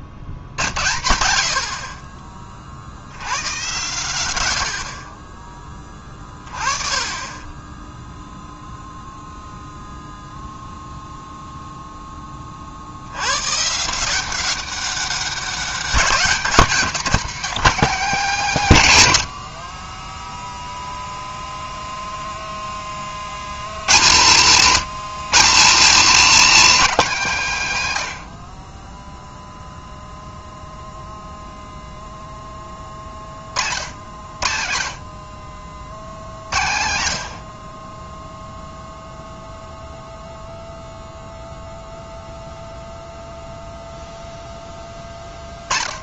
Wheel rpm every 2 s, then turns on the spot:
60, 70, 40, 30, 0, 0, 70, 190, 190, 120, 0, 20, 110, 180, 10, 0, 30, 50, 70, 0, 0, 0, 20.
none